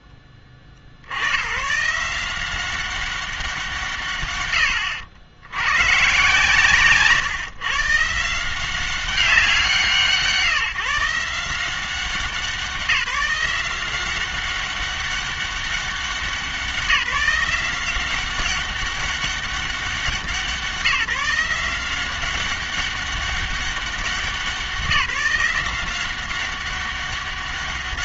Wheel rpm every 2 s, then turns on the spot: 30, 190, 100, 130, 180, 160, 180, 190, 180, 200, 170, 200, 180, 200.
none